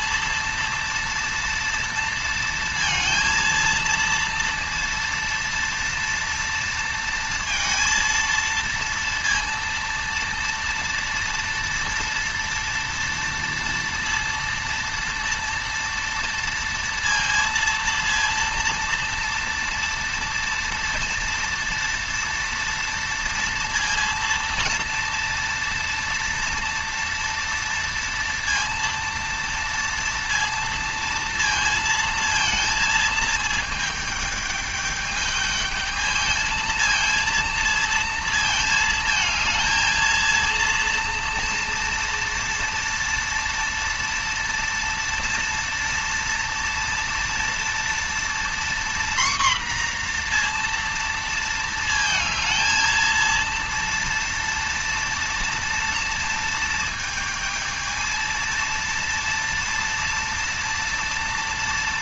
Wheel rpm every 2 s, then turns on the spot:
230, 230, 230, 230, 230, 230, 230, 230, 230, 230, 230, 230, 230, 230, 230, 230, 230, 210, 230, 220, 230, 240, 240, 230, 240, 230, 230, 230, 220, 230, 230.
none